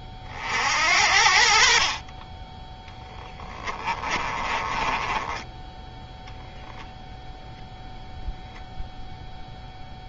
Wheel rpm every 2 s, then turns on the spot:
60, 10, 20, 0, 0.
4-6